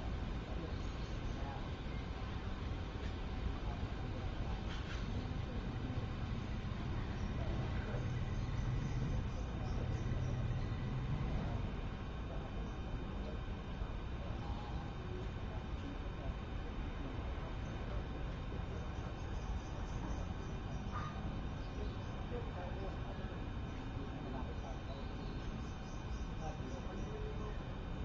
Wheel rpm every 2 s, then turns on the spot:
0, 0, 0, 0, 0, 0, 0, 0, 0, 0, 0, 0, 0, 0.
none